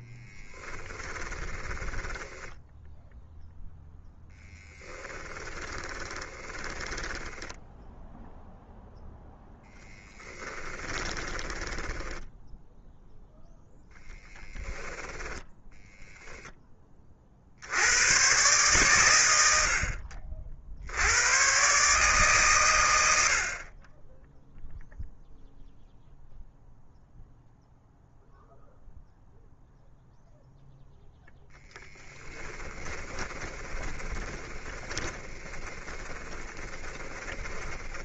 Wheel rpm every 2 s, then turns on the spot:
10, 10, 10, 10, 0, 20, 0, 10, 20, 120, 80, 90, 0, 0, 0, 0, 20, 20, 20.
0-8 10-12 14-16 32-38